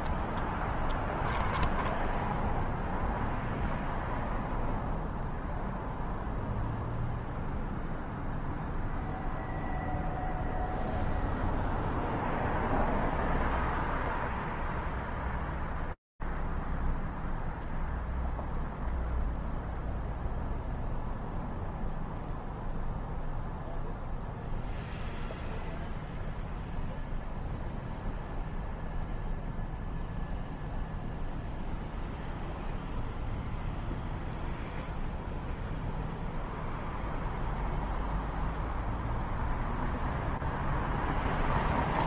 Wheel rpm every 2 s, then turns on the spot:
20, 0, 0, 0, 0, 0, 0, 0, 0, 0, 0, 0, 0, 0, 0, 0, 0, 0, 0, 0, 0.
0-2